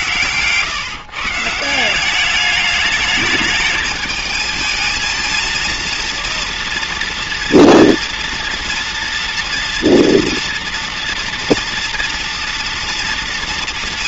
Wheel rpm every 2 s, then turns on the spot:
140, 210, 220, 230, 240, 240, 230.
none